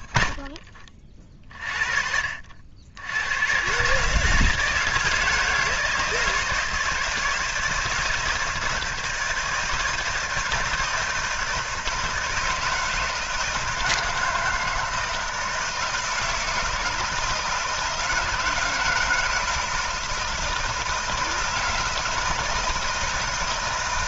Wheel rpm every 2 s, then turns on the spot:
30, 60, 160, 160, 160, 160, 160, 160, 160, 160, 160, 160.
none